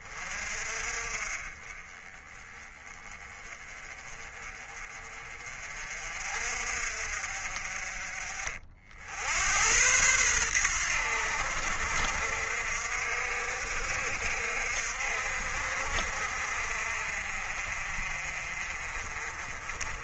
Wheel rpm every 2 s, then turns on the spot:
40, 20, 30, 50, 60, 90, 60, 60, 50, 40.
none